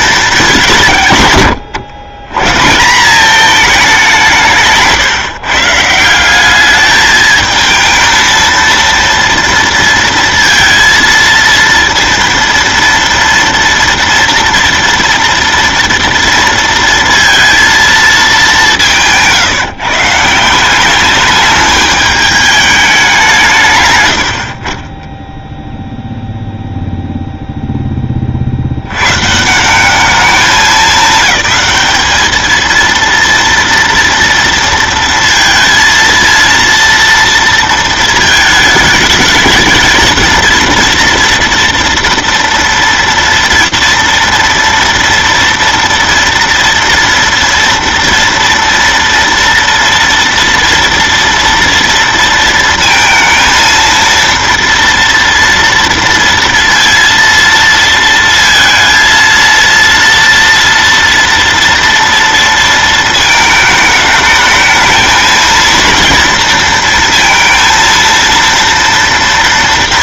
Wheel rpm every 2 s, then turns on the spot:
180, 150, 160, 210, 230, 230, 230, 230, 230, 190, 190, 210, 50, 0, 80, 200, 230, 230, 230, 220, 230, 230, 230, 230, 230, 230, 230, 230, 230, 230, 230, 230, 220, 230, 230.
none